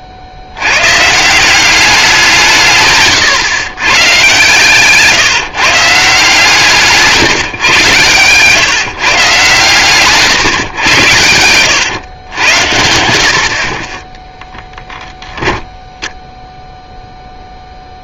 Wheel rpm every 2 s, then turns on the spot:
70, 150, 130, 150, 140, 120, 90, 10, 0.
6-8